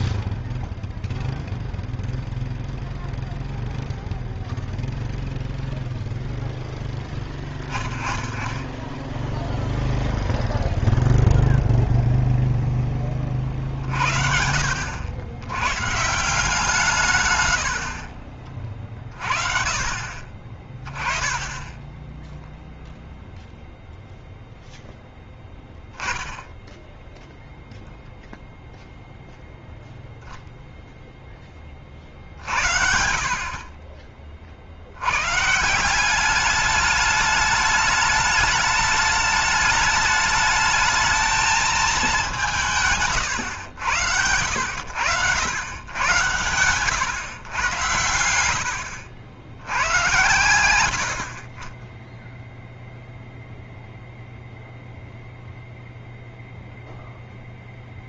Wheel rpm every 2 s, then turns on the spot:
0, 0, 0, 0, 10, 0, 0, 70, 160, 40, 40, 0, 0, 10, 0, 0, 60, 50, 200, 210, 210, 180, 100, 120, 80, 90, 0, 0, 0.
none